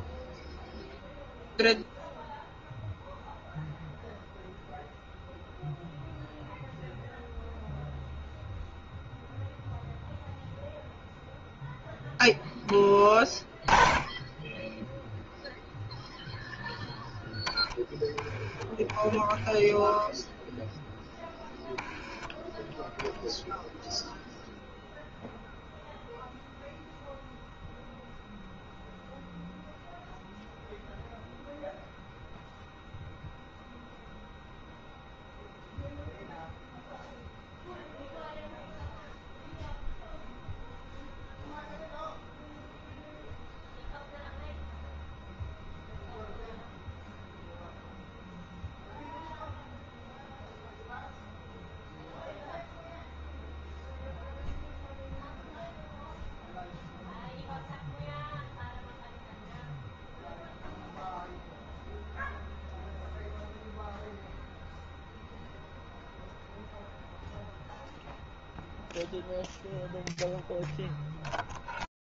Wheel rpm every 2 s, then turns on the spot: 0, 0, 0, 0, 0, 0, 20, 0, 10, 10, 10, 0, 0, 0, 0, 0, 0, 0, 0, 0, 0, 0, 0, 0, 0, 0, 0, 0, 0, 0, 0, 0, 0, 0, 0, 0.
none